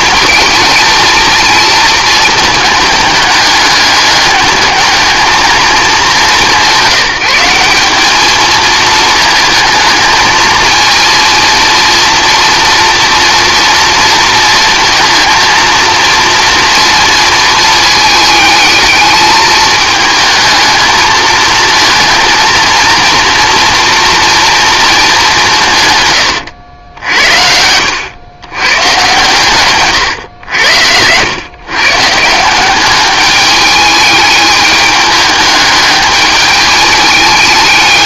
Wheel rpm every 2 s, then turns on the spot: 220, 220, 210, 190, 220, 220, 230, 230, 230, 220, 220, 230, 230, 100, 110, 90, 190, 210, 210.
none